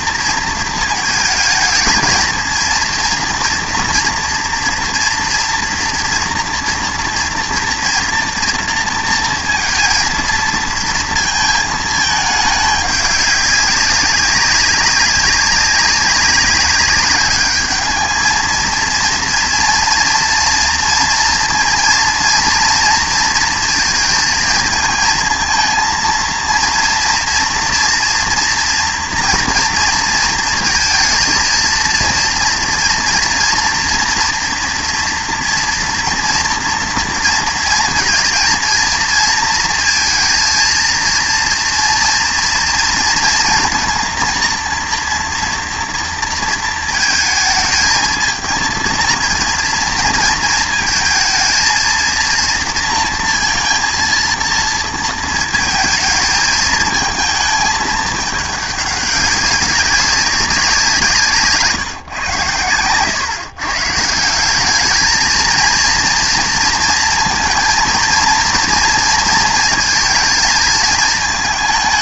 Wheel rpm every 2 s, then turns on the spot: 230, 230, 230, 230, 230, 230, 210, 190, 190, 230, 230, 230, 220, 230, 240, 230, 240, 240, 230, 230, 230, 230, 230, 230, 230, 230, 230, 230, 220, 200, 180, 110, 200, 230, 230, 220.
none